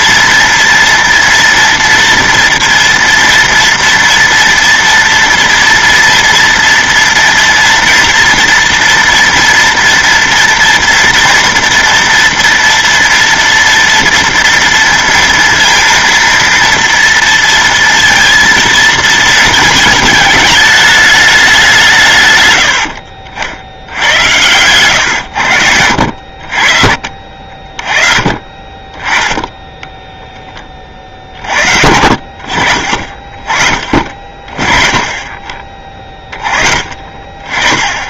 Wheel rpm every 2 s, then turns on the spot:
230, 230, 230, 230, 230, 230, 230, 230, 230, 230, 210, 100, 110, 50, 20, 30, 50, 30, 20.
none